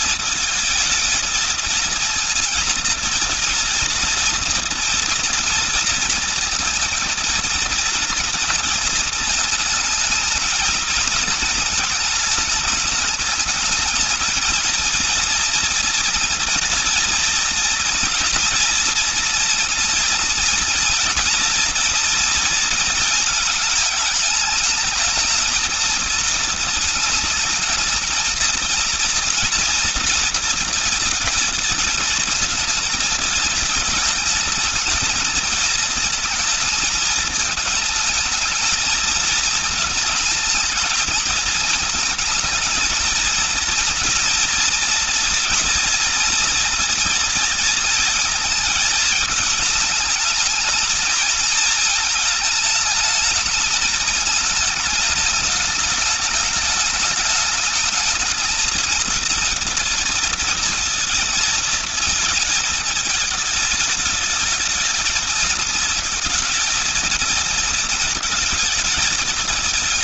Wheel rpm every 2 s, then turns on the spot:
220, 230, 240, 230, 220, 220, 210, 230, 240, 230, 230, 230, 210, 220, 230, 230, 230, 220, 220, 220, 220, 230, 230, 230, 220, 220, 220, 210, 210, 220, 230, 220, 220, 220, 220.
none